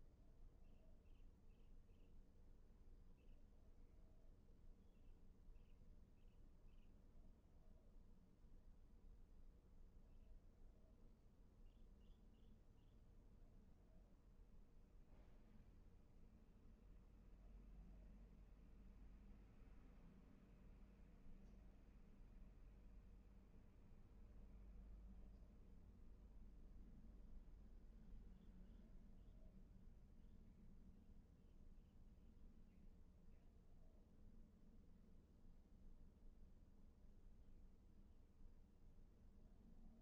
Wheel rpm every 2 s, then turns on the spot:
0, 0, 0, 0, 0, 0, 0, 0, 0, 0, 0, 0, 0, 0, 0, 0, 0, 0, 0, 0.
none